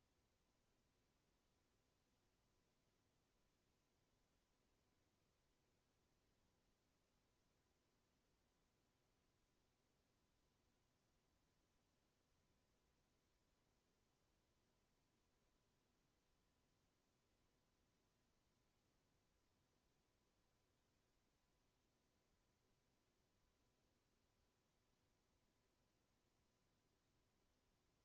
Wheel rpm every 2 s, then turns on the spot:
0, 0, 0, 0, 0, 0, 0, 0, 0, 0, 0, 0, 0, 0.
none